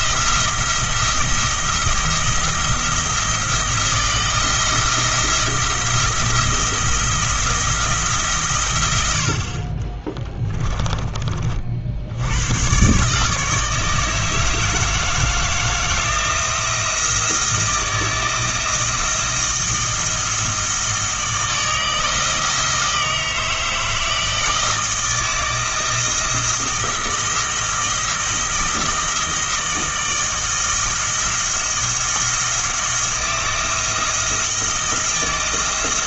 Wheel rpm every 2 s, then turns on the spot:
170, 170, 170, 160, 120, 10, 130, 160, 170, 160, 160, 160, 160, 160, 160, 160, 170, 160.
10-12